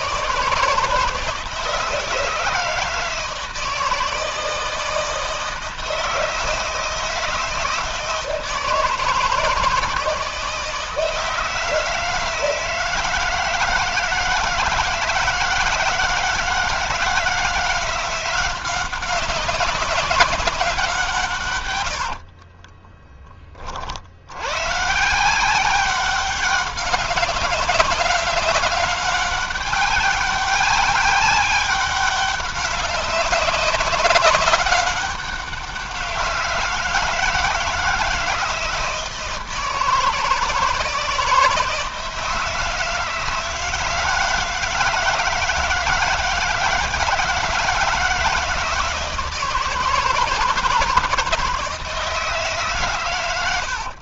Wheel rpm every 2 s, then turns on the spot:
160, 160, 160, 160, 160, 160, 160, 160, 160, 180, 190, 40, 100, 190, 190, 200, 200, 190, 170, 160, 160, 160, 160, 160, 160, 160, 150.
22-24